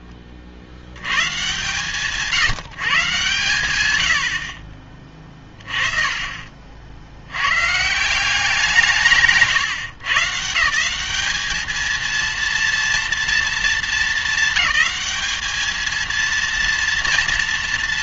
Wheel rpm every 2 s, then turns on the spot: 50, 150, 40, 60, 170, 170, 230, 210, 230.
none